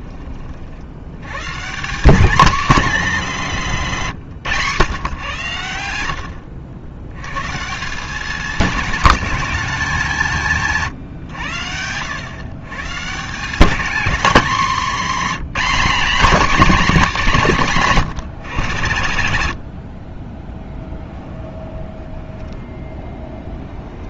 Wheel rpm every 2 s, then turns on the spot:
80, 230, 140, 80, 210, 150, 160, 230, 240, 110, 10, 20.
20-24